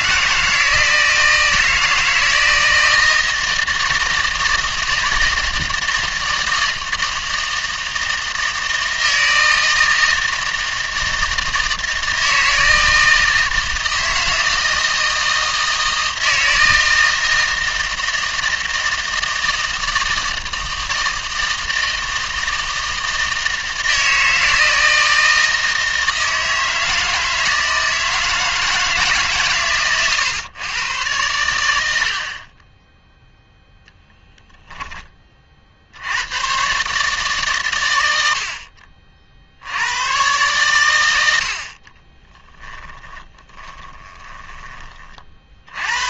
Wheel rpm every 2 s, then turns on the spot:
160, 160, 160, 160, 160, 160, 160, 160, 160, 160, 160, 160, 160, 160, 160, 110, 10, 10, 130, 50, 110, 20, 20.
42-44